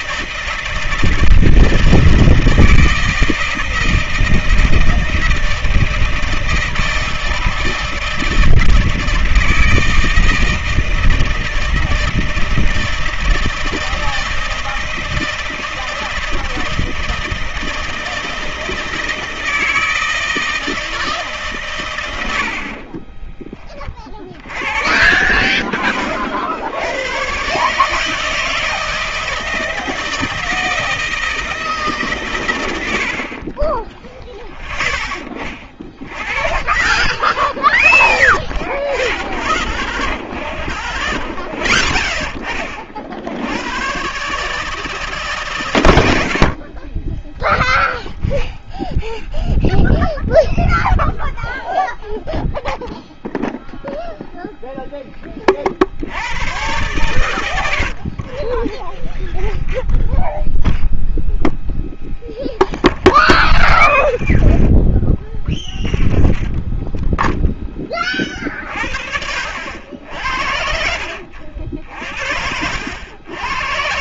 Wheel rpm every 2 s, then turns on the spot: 160, 160, 160, 160, 160, 160, 160, 160, 160, 160, 160, 50, 70, 80, 160, 160, 90, 10, 20, 20, 30, 40, 150, 40, 0, 0, 0, 0, 100, 20, 10, 20, 30, 10, 50, 60, 80.
22-24 40-42 58-68